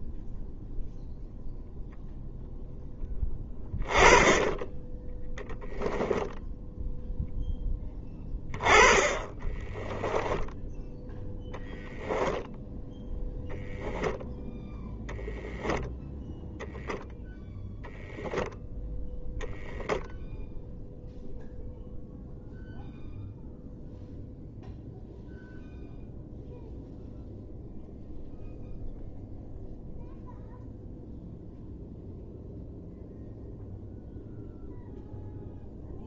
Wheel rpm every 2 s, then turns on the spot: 0, 0, 20, 0, 20, 0, 0, 0, 0, 10, 0, 0, 0, 0, 0, 0, 0, 0.
none